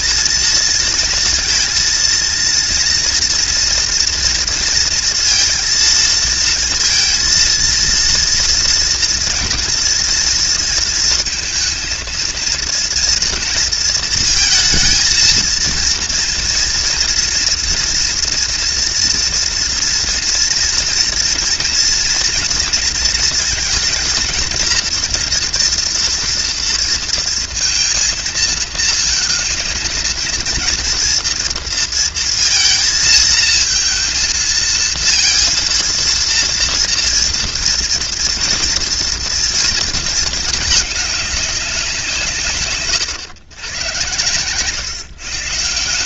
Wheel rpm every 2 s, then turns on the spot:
230, 230, 230, 230, 230, 230, 230, 230, 230, 230, 230, 230, 230, 230, 230, 230, 230, 220, 230, 230, 220, 130, 130.
none